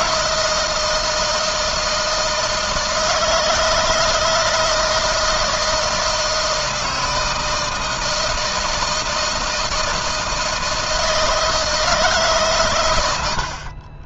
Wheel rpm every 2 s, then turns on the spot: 160, 160, 160, 160, 160, 160, 90.
none